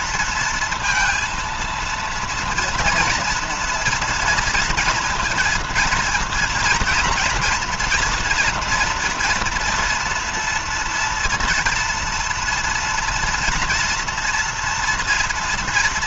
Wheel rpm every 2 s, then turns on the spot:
230, 230, 230, 230, 230, 240, 230, 230.
none